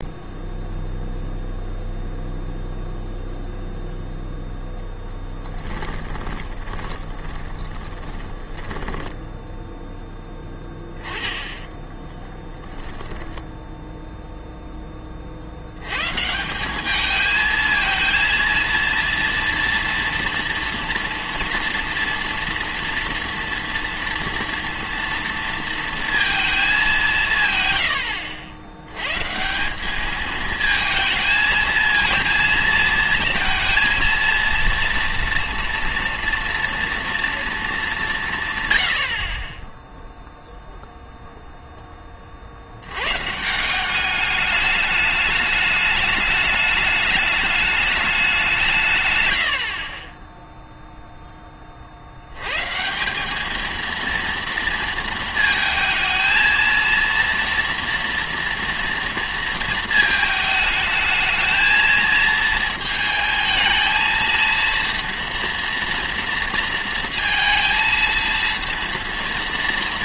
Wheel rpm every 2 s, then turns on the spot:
0, 0, 0, 20, 10, 10, 0, 0, 180, 230, 240, 230, 230, 210, 80, 220, 220, 230, 240, 120, 0, 60, 210, 210, 160, 0, 130, 230, 230, 230, 220, 220, 230, 230, 230.
6-10